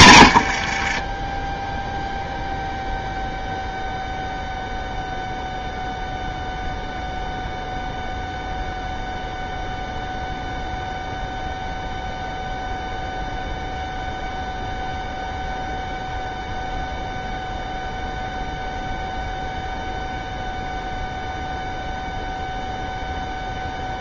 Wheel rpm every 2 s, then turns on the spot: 50, 0, 0, 0, 0, 0, 0, 0, 0, 0, 0, 0.
0-2